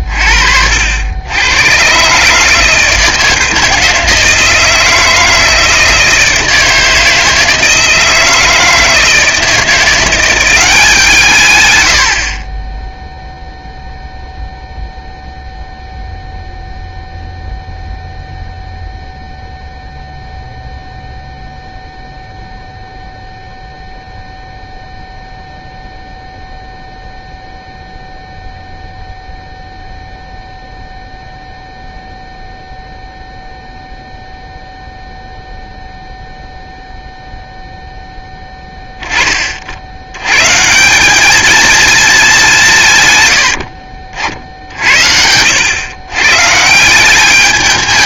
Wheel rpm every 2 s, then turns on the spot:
80, 160, 160, 160, 160, 160, 0, 0, 0, 0, 0, 0, 0, 0, 0, 0, 0, 0, 0, 70, 220, 50, 100, 210.
42-44